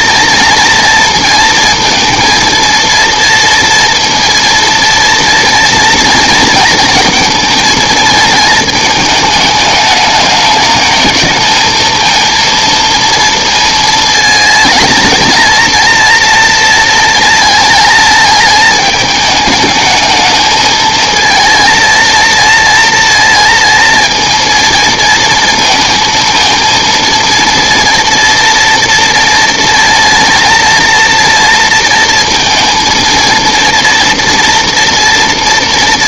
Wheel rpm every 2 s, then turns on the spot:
230, 230, 230, 240, 220, 210, 230, 230, 230, 220, 220, 230, 230, 230, 230, 230, 220, 230.
none